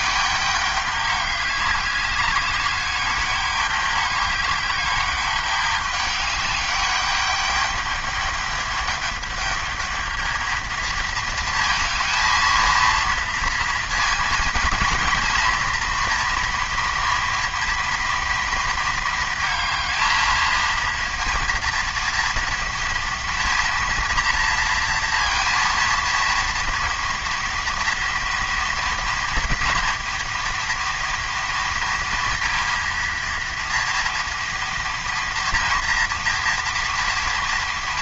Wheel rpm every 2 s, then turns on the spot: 200, 200, 200, 200, 210, 220, 230, 230, 230, 220, 230, 230, 230, 230, 230, 240, 230, 230, 230.
none